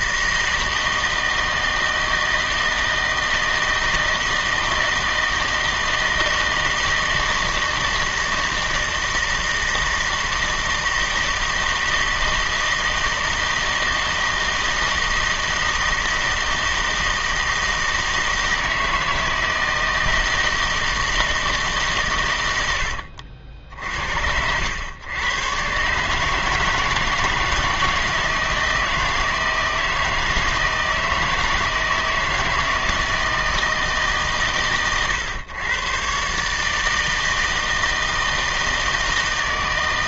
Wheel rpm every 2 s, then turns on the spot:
160, 160, 160, 160, 160, 160, 160, 160, 160, 160, 160, 100, 90, 160, 160, 160, 160, 110, 150, 160.
none